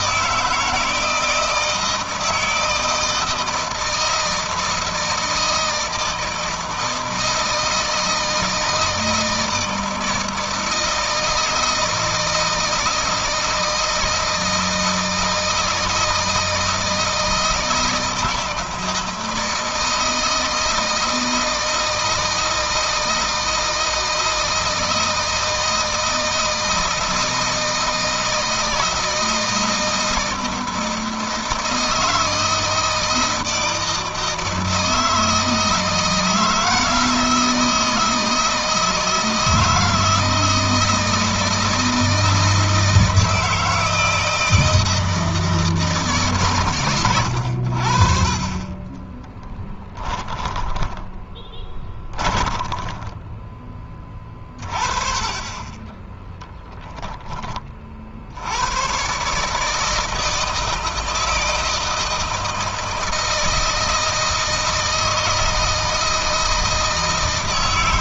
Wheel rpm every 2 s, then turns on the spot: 170, 160, 160, 160, 160, 160, 160, 160, 160, 160, 160, 160, 160, 160, 160, 160, 160, 160, 160, 160, 160, 160, 160, 110, 30, 10, 20, 40, 10, 120, 160, 160, 160, 160.
48-54